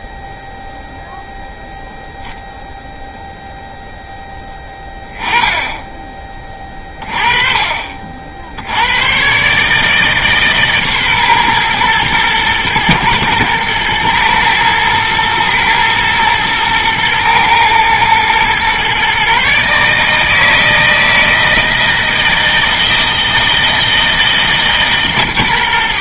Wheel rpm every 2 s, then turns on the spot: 0, 0, 10, 30, 80, 140, 110, 110, 110, 130, 160, 160, 150.
none